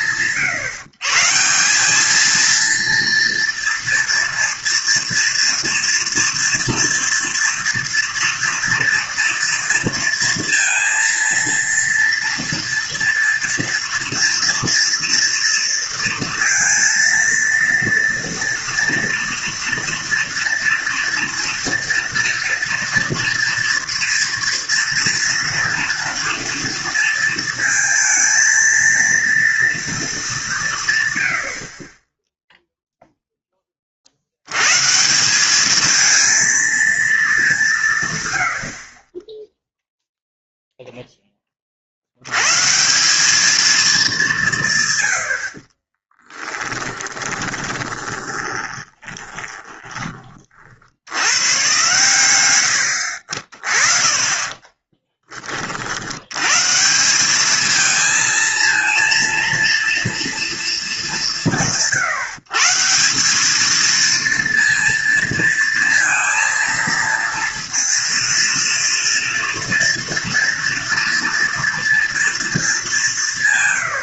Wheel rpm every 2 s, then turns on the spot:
140, 210, 230, 230, 230, 230, 230, 230, 230, 230, 230, 240, 230, 230, 220, 210, 10, 100, 230, 60, 0, 140, 140, 10, 20, 50, 100, 30, 140, 230, 200, 160, 230, 230, 230, 230, 200.
38-40 46-50 54-56